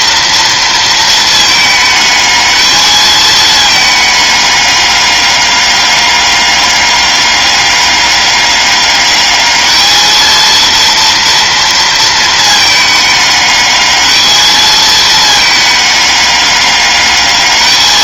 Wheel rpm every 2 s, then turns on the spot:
230, 220, 200, 200, 200, 230, 220, 220, 200.
none